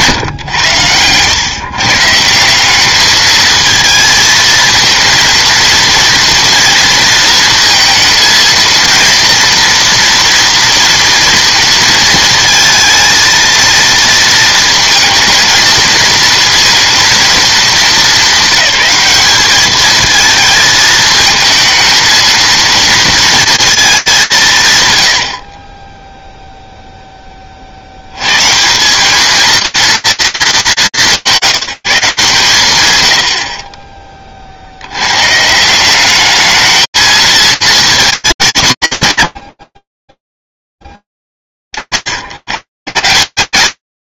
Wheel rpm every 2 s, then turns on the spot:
110, 190, 230, 230, 230, 230, 220, 220, 230, 200, 220, 230, 120, 0, 170, 170, 120, 70, 220, 130, 10, 120.
none